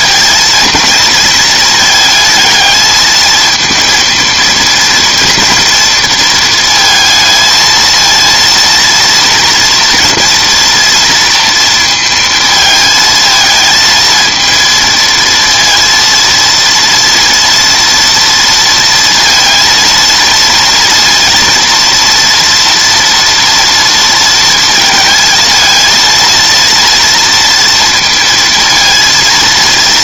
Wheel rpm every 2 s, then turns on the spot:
230, 220, 230, 230, 230, 230, 220, 230, 230, 230, 230, 230, 230, 230, 230.
none